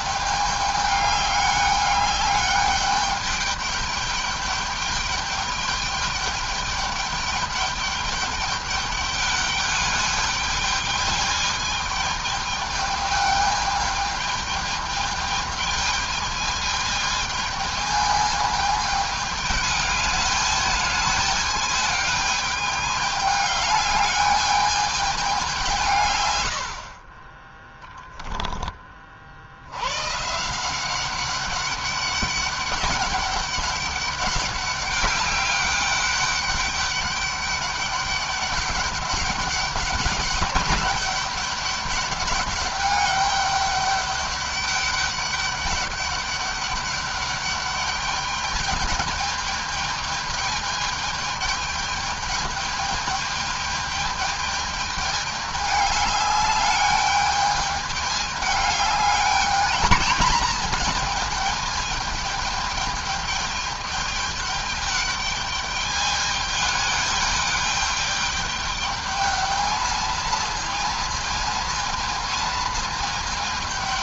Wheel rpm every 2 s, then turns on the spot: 210, 210, 210, 210, 200, 210, 210, 210, 220, 210, 210, 210, 210, 50, 20, 180, 200, 200, 200, 200, 200, 200, 200, 200, 210, 210, 210, 210, 210, 210, 220, 210, 210, 210, 210, 230, 220.
none